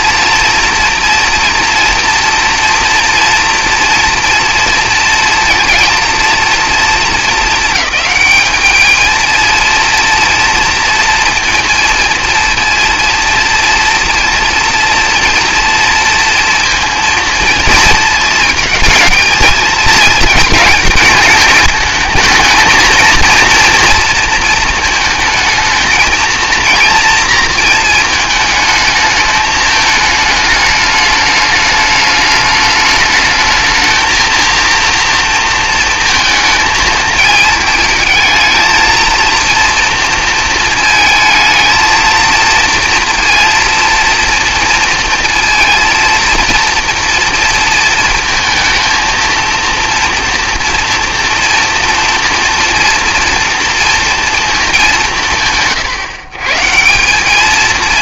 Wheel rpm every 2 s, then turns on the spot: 230, 230, 230, 230, 220, 230, 230, 230, 230, 230, 220, 220, 220, 230, 210, 210, 210, 230, 220, 220, 220, 230, 230, 230, 230, 230, 230, 200, 170.
none